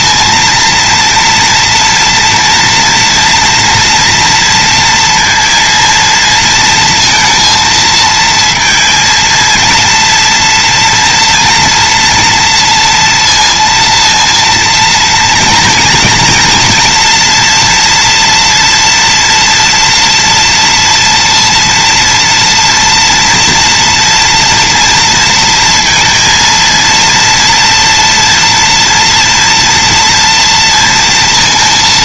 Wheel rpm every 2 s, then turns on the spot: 230, 240, 230, 230, 230, 230, 230, 230, 230, 240, 230, 240, 230, 230, 240, 230.
none